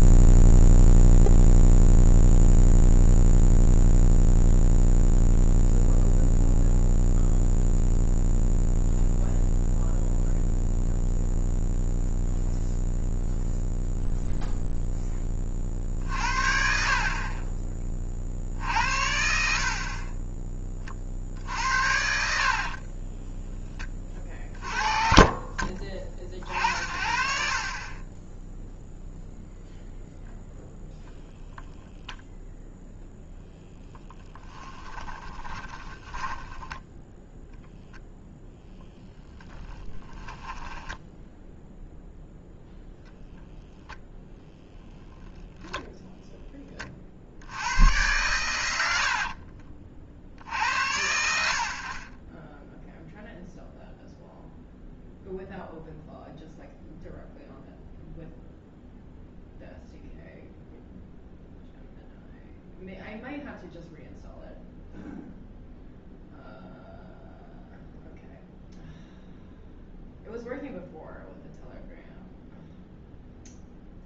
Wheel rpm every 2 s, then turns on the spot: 0, 0, 0, 0, 0, 0, 0, 0, 40, 70, 40, 30, 40, 50, 0, 0, 0, 20, 10, 0, 10, 0, 20, 30, 70, 80, 0, 0, 0, 0, 0, 0, 0, 0, 0, 0, 0.
22-24 34-36 40-42